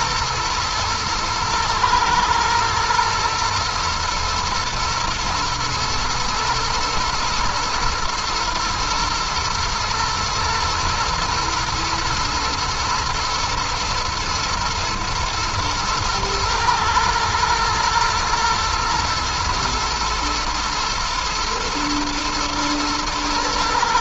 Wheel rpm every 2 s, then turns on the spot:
110, 120, 110, 110, 120, 120, 110, 110, 110, 120, 120, 110.
none